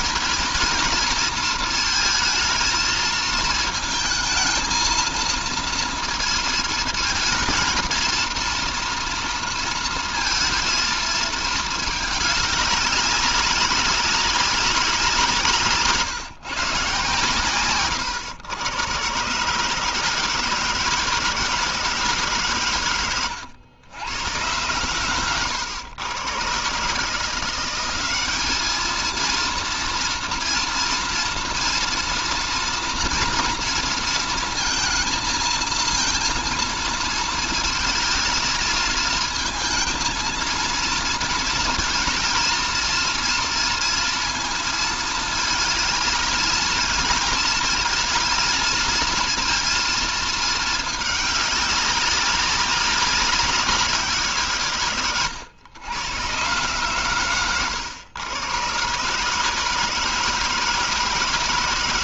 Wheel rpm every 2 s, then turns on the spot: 230, 220, 230, 230, 230, 220, 190, 190, 150, 140, 160, 120, 110, 150, 230, 230, 230, 220, 230, 220, 230, 230, 220, 210, 230, 210, 190, 120, 120, 140, 160.
24-26